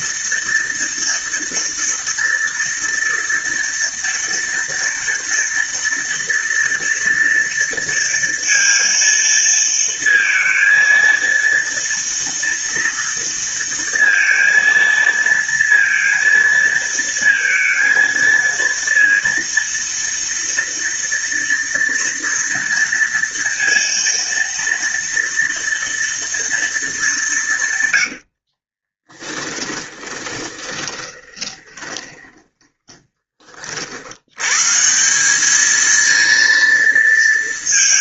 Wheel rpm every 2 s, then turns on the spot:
230, 230, 230, 230, 230, 230, 230, 230, 230, 230, 230, 230, 230, 220, 40, 20, 30, 120, 230.
28-34